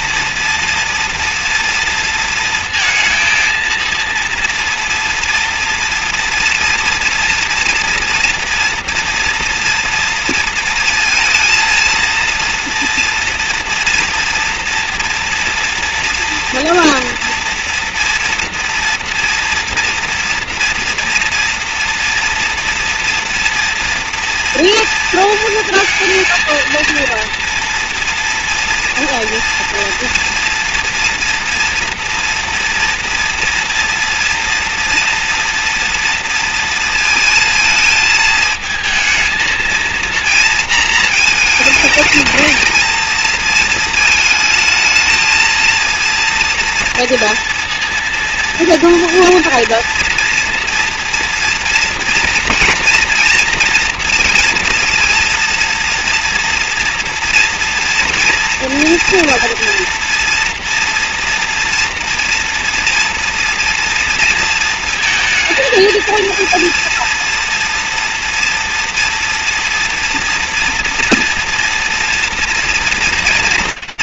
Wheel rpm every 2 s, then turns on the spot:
230, 230, 230, 230, 230, 230, 230, 230, 230, 240, 230, 230, 230, 230, 230, 230, 230, 230, 230, 220, 230, 220, 220, 230, 230, 230, 240, 240, 240, 240, 240, 230, 230, 230, 230, 230, 230.
none